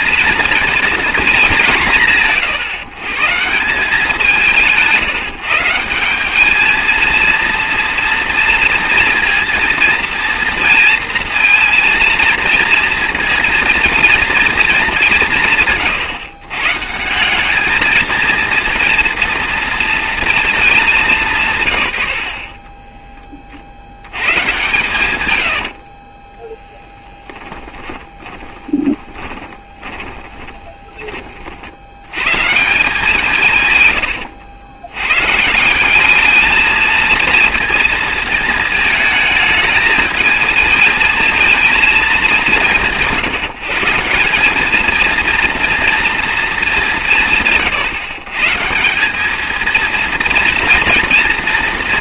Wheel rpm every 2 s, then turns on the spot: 230, 140, 170, 220, 230, 230, 230, 210, 150, 230, 210, 20, 120, 10, 20, 20, 170, 90, 220, 220, 220, 170, 220, 200, 170, 230.
26-30